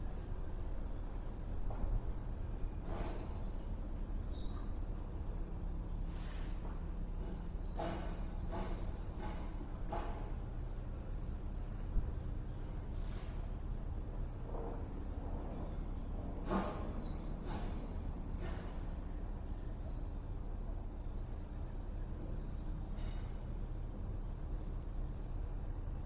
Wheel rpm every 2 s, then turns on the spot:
0, 0, 0, 0, 0, 0, 0, 0, 0, 0, 0, 0, 0.
none